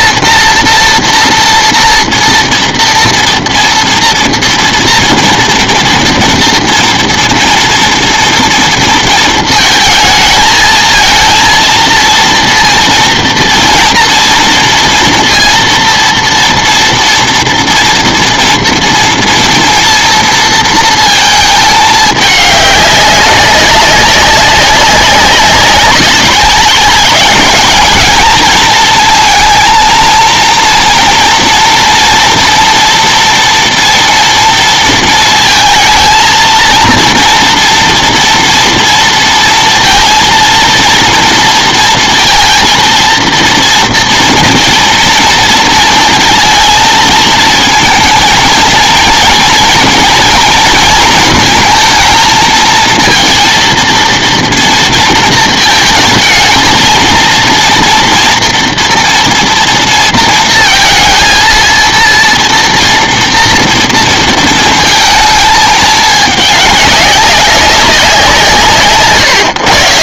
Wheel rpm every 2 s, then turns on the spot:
230, 230, 230, 230, 230, 220, 230, 230, 230, 230, 230, 200, 190, 200, 220, 230, 230, 230, 230, 230, 230, 230, 230, 230, 230, 230, 220, 230, 220, 230, 230, 230, 230, 200, 160.
none